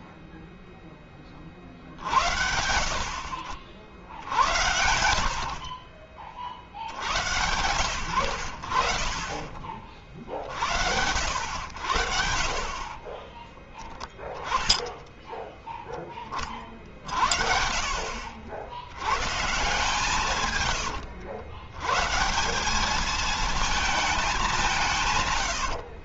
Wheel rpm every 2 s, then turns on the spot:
10, 60, 80, 80, 50, 80, 30, 10, 50, 100, 90, 210, 140.
12-14 20-22